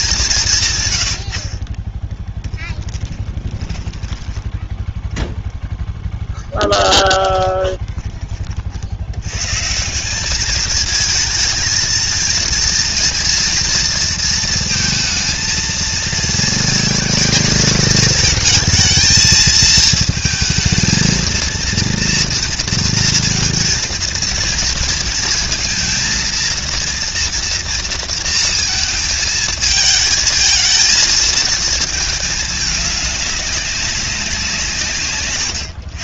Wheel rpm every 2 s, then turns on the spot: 110, 20, 0, 10, 80, 220, 230, 230, 220, 230, 220, 230, 230, 230, 220, 220, 210, 140.
0-4 6-8